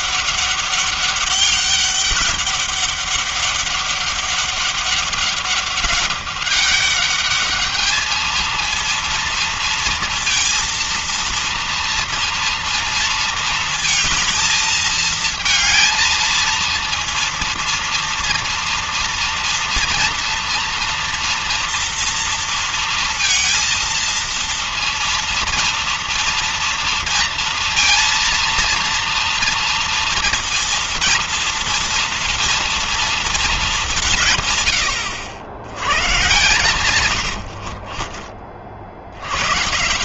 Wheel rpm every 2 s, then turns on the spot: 200, 200, 200, 200, 220, 230, 230, 220, 230, 230, 230, 230, 230, 230, 230, 230, 230, 130, 130, 50.
none